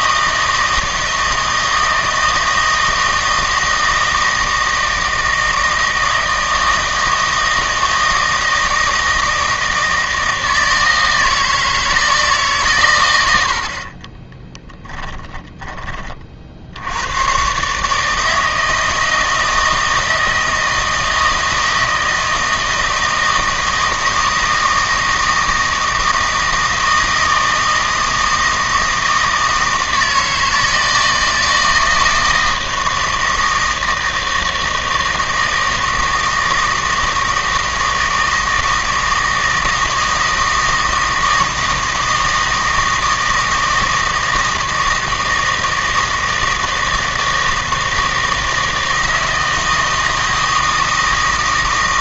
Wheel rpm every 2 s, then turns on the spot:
160, 160, 160, 160, 160, 160, 130, 10, 80, 160, 160, 160, 160, 160, 160, 160, 160, 160, 160, 160, 160, 160, 160, 160, 160, 160.
14-16